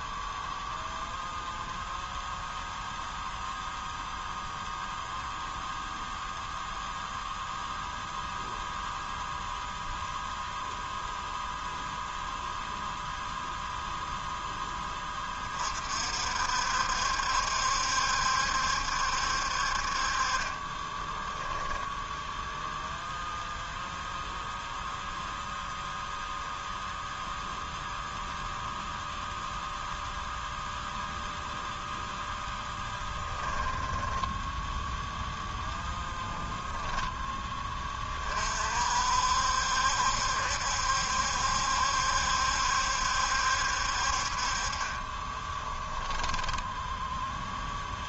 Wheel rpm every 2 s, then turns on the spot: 0, 0, 0, 0, 0, 0, 0, 10, 60, 70, 20, 0, 0, 0, 0, 0, 10, 10, 10, 50, 70, 70, 40, 10.
20-22 32-34 36-38 46-48